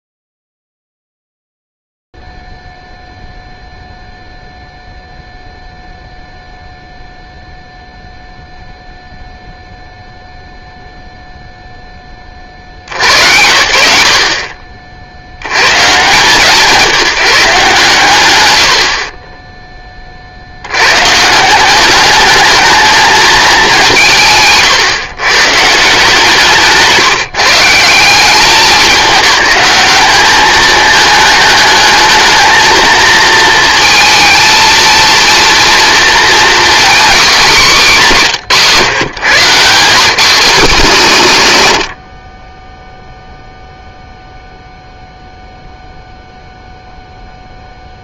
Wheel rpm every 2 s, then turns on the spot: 0, 0, 0, 0, 0, 0, 40, 50, 160, 110, 80, 220, 130, 170, 200, 210, 220, 230, 240, 140, 200, 20, 0, 0.
none